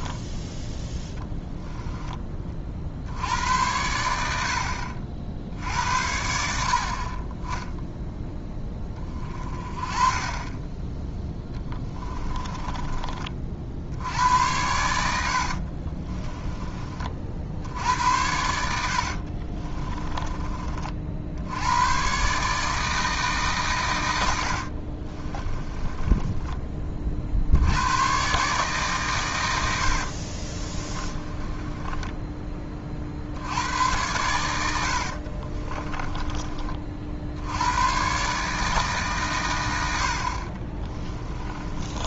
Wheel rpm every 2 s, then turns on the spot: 10, 40, 70, 60, 20, 10, 30, 90, 30, 70, 40, 150, 60, 20, 140, 30, 30, 80, 40, 150, 30.
12-14 24-26 30-32 34-36 40-42